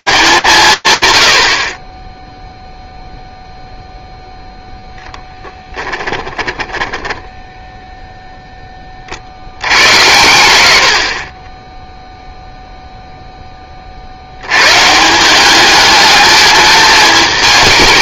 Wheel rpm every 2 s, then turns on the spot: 90, 0, 10, 10, 50, 20, 10, 190, 220.
4-8